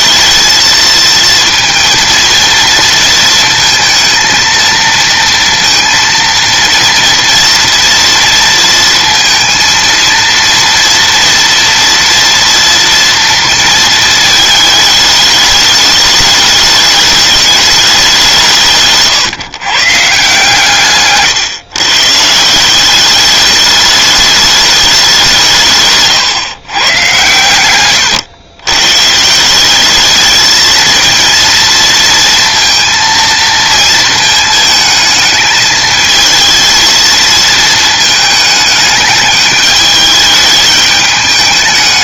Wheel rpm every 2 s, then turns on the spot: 220, 230, 230, 230, 230, 230, 230, 210, 210, 150, 150, 190, 200, 130, 120, 220, 230, 220, 230, 210, 210.
none